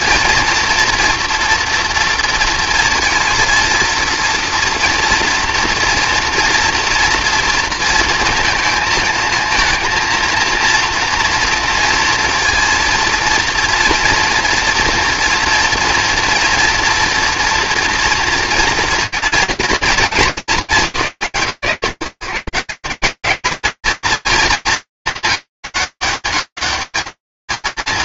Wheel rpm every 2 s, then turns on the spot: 230, 230, 230, 230, 220, 230, 230, 230, 240, 240, 180, 180, 220, 180.
none